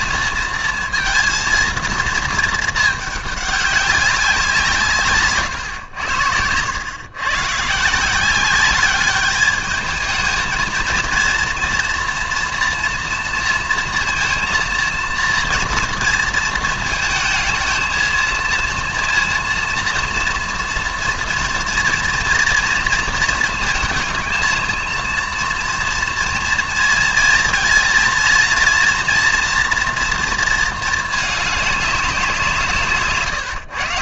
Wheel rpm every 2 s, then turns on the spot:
230, 220, 170, 100, 200, 220, 230, 230, 230, 230, 230, 240, 230, 230, 230, 230, 170.
none